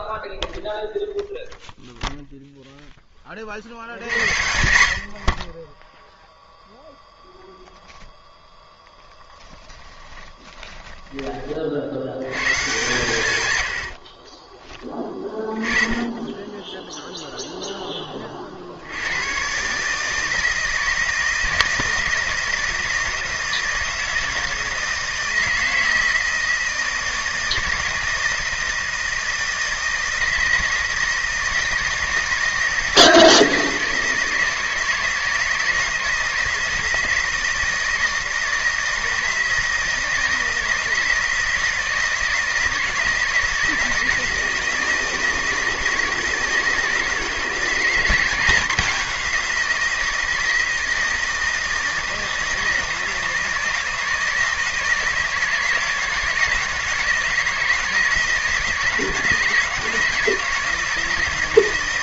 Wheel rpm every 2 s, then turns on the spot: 0, 40, 40, 0, 10, 30, 100, 20, 0, 130, 160, 160, 160, 160, 160, 160, 160, 160, 170, 160, 160, 160, 160, 160, 180, 160, 160, 160, 160, 160, 160.
8-10